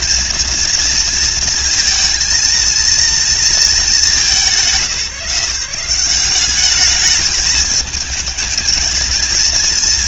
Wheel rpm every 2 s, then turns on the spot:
230, 230, 150, 210, 230.
none